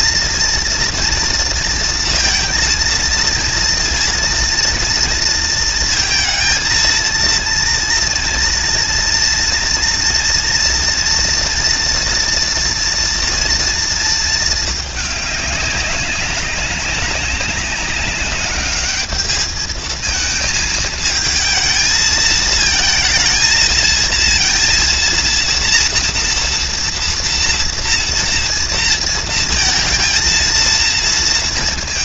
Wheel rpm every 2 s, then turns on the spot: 230, 230, 230, 230, 230, 230, 230, 230, 200, 200, 220, 220, 230, 230, 230, 230.
none